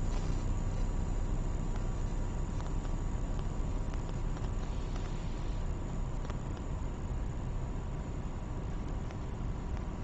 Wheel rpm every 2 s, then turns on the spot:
0, 0, 0, 0, 0.
none